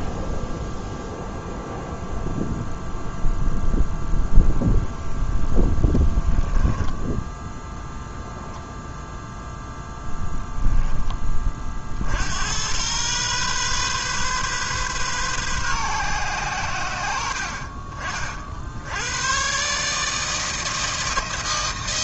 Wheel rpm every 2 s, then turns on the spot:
0, 0, 0, 10, 0, 10, 100, 130, 110, 70, 160.
6-8